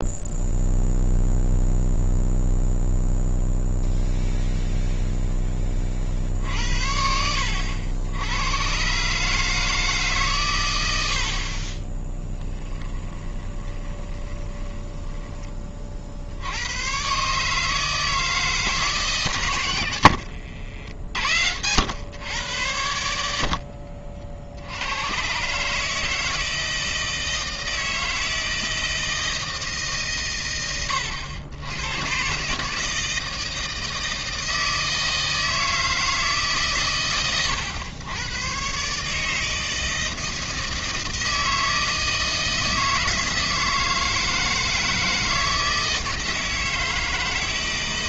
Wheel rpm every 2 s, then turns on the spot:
0, 0, 0, 60, 110, 110, 20, 10, 100, 150, 80, 100, 80, 160, 160, 100, 150, 160, 140, 130, 160, 160, 160, 160.
12-16